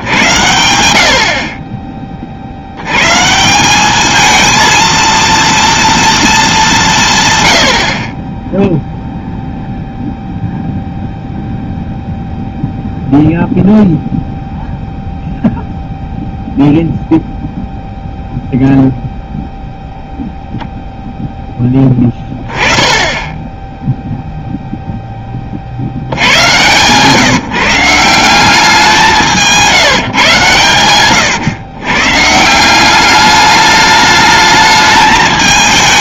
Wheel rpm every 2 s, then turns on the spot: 90, 70, 230, 180, 0, 0, 0, 0, 0, 0, 0, 20, 0, 130, 190, 130, 170, 220.
22-24